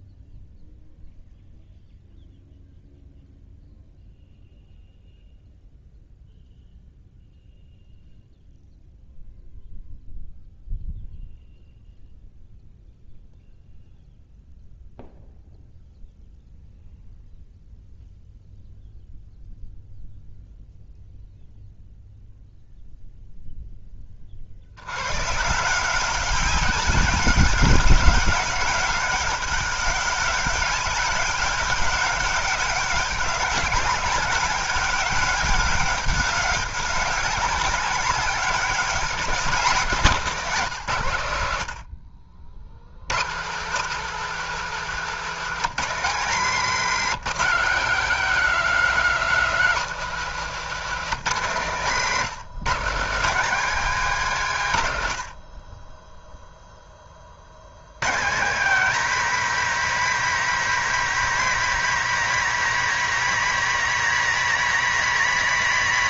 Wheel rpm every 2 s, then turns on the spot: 0, 0, 0, 0, 0, 0, 0, 0, 0, 0, 0, 0, 70, 190, 190, 200, 190, 190, 190, 200, 190, 80, 220, 220, 210, 210, 180, 160, 0, 210, 250, 250, 250.
none